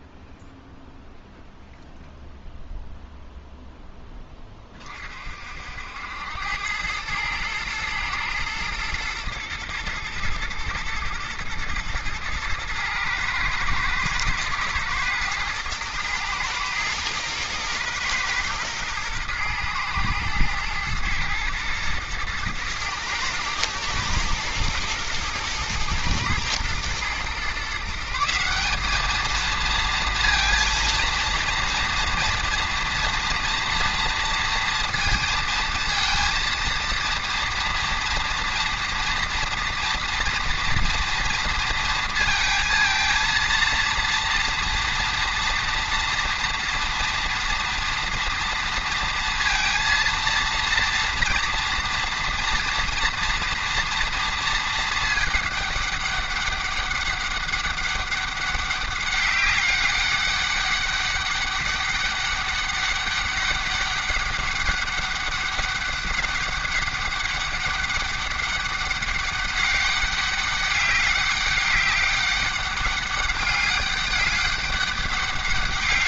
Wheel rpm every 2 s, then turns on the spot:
0, 0, 20, 100, 120, 110, 110, 110, 120, 120, 120, 110, 110, 110, 190, 230, 230, 230, 230, 230, 230, 230, 230, 230, 230, 230, 230, 230, 200, 200, 200, 200, 200, 200, 200, 200, 200, 200.
none